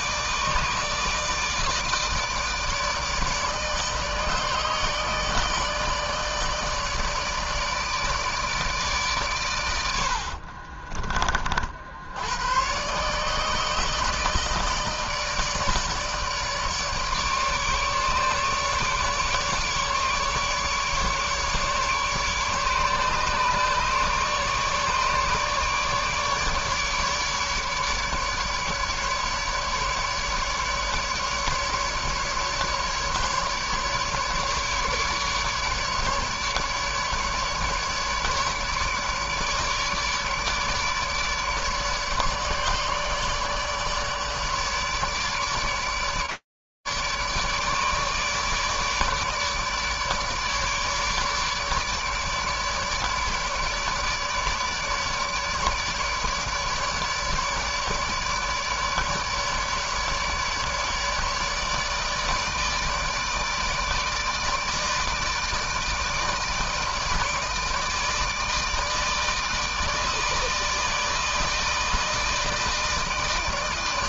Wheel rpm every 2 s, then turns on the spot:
160, 160, 150, 160, 140, 40, 130, 160, 150, 150, 150, 150, 150, 150, 150, 150, 150, 150, 140, 150, 150, 150, 150, 150, 150, 150, 150, 150, 150, 150, 150, 160, 160, 150, 160, 160, 160.
none